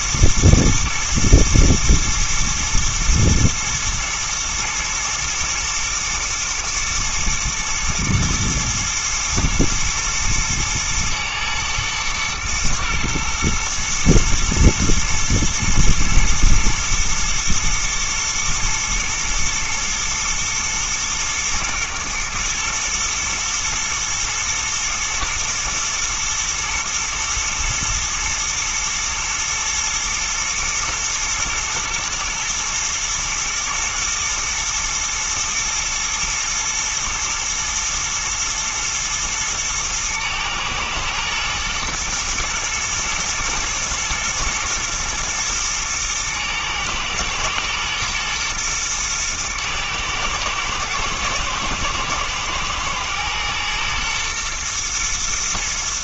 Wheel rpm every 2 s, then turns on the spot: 110, 120, 110, 120, 110, 120, 120, 110, 120, 110, 110, 120, 110, 120, 110, 110, 120, 110, 110, 110, 110, 110, 120, 110, 110, 110, 120, 120.
none